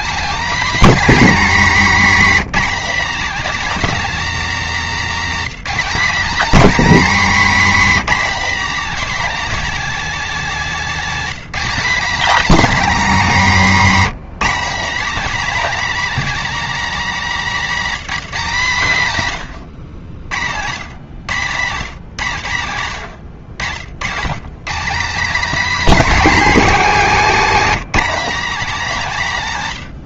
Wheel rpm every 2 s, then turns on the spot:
260, 250, 250, 270, 270, 240, 260, 230, 260, 160, 110, 110, 200, 250, 230.
none